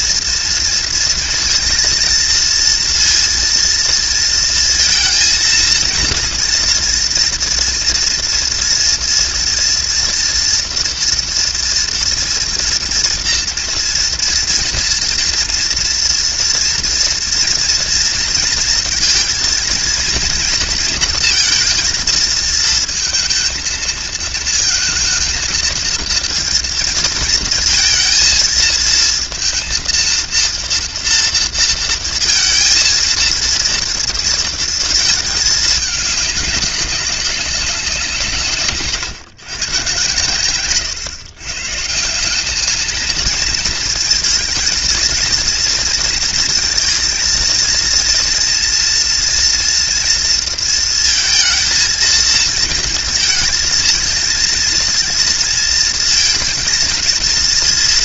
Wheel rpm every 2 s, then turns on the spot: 240, 230, 230, 230, 230, 230, 230, 230, 230, 230, 230, 220, 230, 230, 230, 230, 230, 230, 200, 140, 130, 210, 220, 230, 230, 230, 230, 230, 230.
none